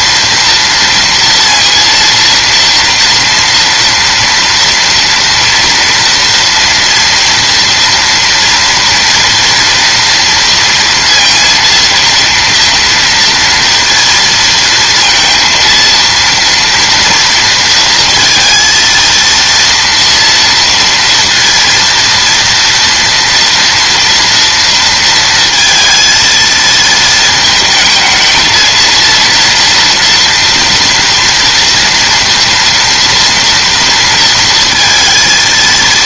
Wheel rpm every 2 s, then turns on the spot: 230, 230, 230, 240, 230, 230, 230, 230, 230, 230, 230, 230, 230, 220, 220, 230, 230, 230.
none